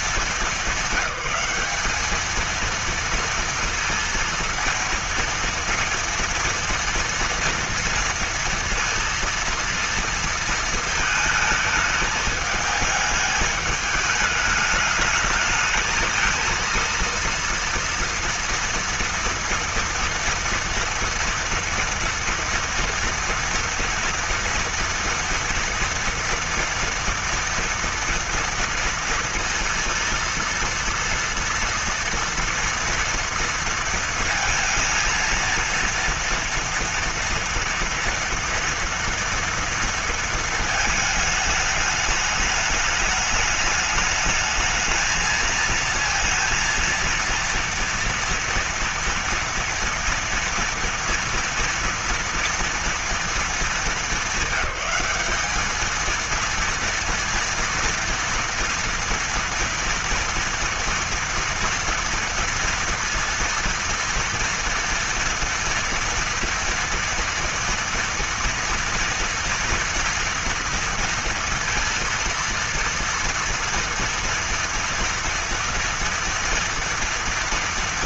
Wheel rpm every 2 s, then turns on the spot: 210, 220, 230, 230, 230, 230, 210, 210, 230, 230, 230, 230, 230, 230, 230, 230, 230, 230, 230, 230, 220, 210, 220, 230, 230, 230, 230, 200, 230, 230, 230, 230, 230, 230, 230, 230, 230, 230, 230.
none